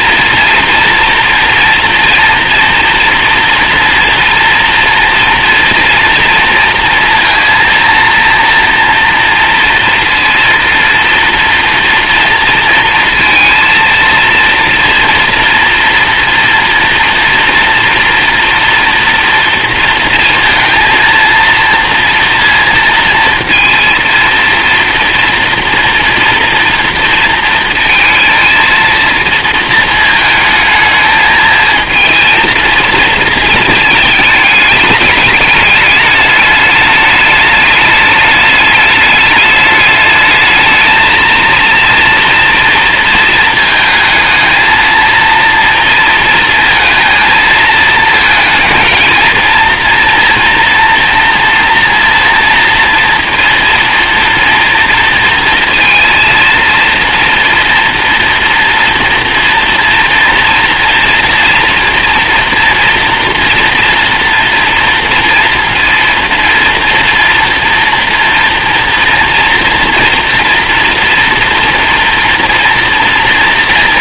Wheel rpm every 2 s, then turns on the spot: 240, 230, 230, 230, 230, 230, 230, 230, 240, 230, 230, 230, 230, 230, 230, 220, 230, 210, 210, 210, 220, 230, 220, 220, 220, 230, 230, 230, 230, 230, 230, 240, 230, 230, 240, 230, 230.
none